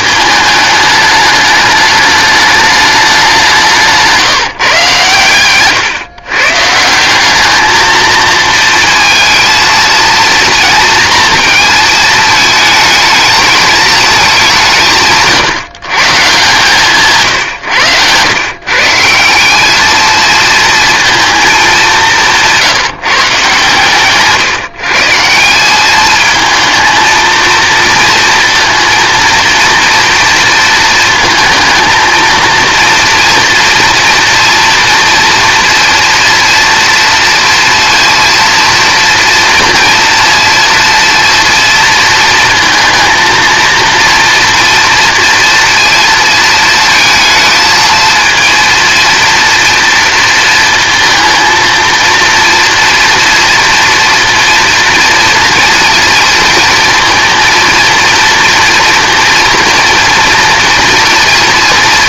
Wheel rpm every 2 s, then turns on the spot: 220, 210, 140, 170, 230, 230, 220, 160, 150, 150, 230, 160, 150, 230, 230, 220, 230, 230, 230, 230, 230, 220, 230, 220, 230, 230, 230, 230, 230, 240, 230.
none